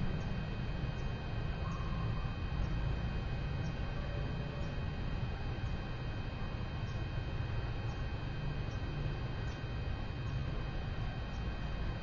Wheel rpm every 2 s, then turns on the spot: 0, 0, 0, 0, 0, 0.
none